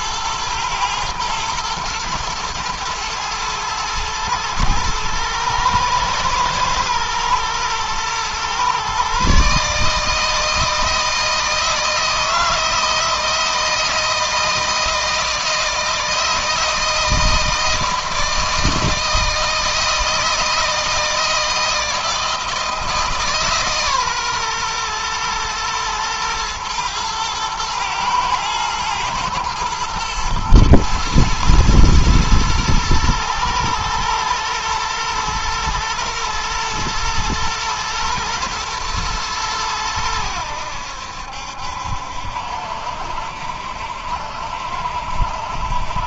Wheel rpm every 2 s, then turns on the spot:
110, 110, 110, 120, 130, 160, 160, 160, 160, 160, 160, 160, 120, 110, 110, 110, 120, 120, 120, 110, 80, 60, 60.
none